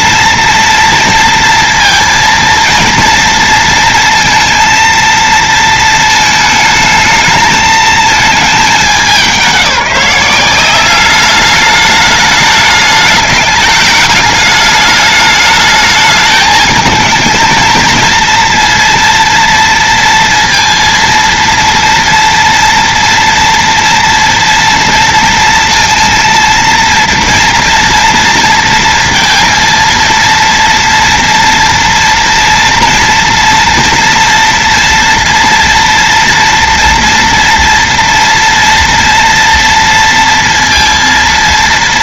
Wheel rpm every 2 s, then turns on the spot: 230, 230, 230, 220, 220, 180, 210, 210, 220, 230, 230, 230, 230, 230, 230, 230, 240, 230, 240, 230, 230.
none